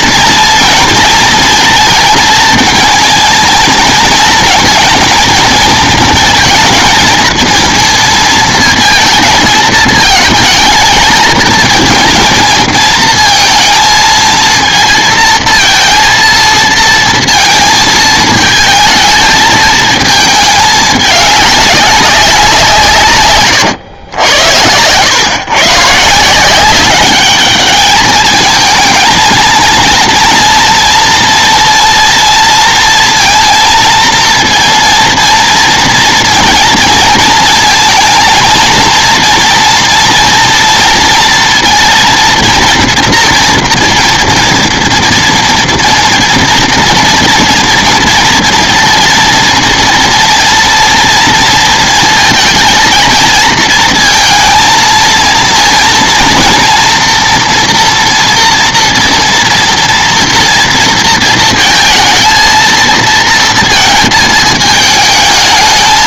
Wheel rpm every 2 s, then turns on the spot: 230, 230, 230, 220, 230, 220, 230, 230, 230, 220, 210, 180, 90, 180, 220, 240, 230, 230, 230, 230, 230, 230, 230, 230, 230, 230, 230, 230, 230, 240, 230, 230, 220.
none